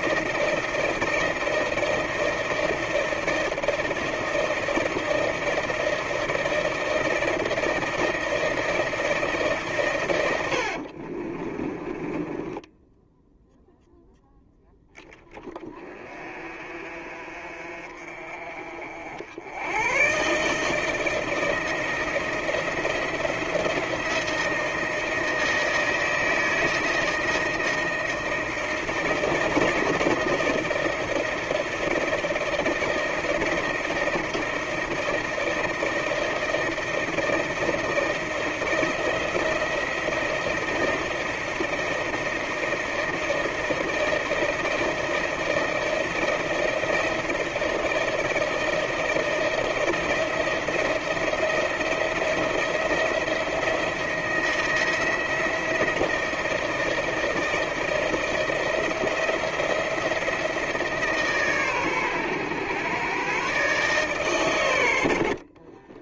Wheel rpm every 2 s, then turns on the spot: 160, 160, 160, 160, 160, 80, 10, 20, 40, 50, 150, 170, 160, 160, 160, 160, 160, 160, 160, 160, 160, 160, 160, 160, 160, 170, 170, 170, 160, 170, 160, 120, 110.
10-14